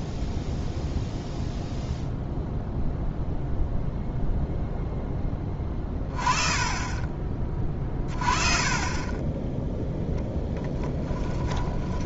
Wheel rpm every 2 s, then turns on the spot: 0, 0, 0, 30, 30, 10.
6-8 10-12